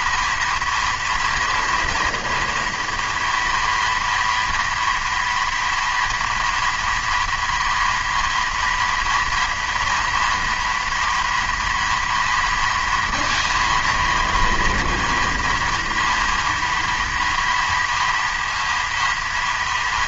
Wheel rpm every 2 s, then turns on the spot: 230, 240, 230, 230, 230, 230, 230, 230, 230, 230.
none